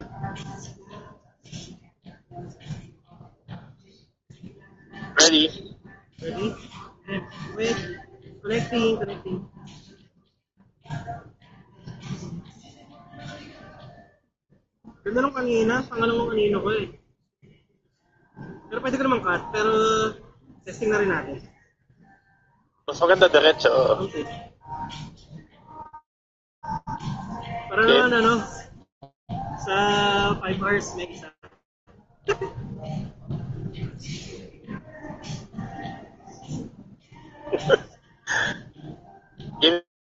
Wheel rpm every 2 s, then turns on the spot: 0, 0, 0, 0, 0, 0, 0, 0, 0, 0, 0, 0, 0, 0, 0, 0, 0, 0, 0, 0.
none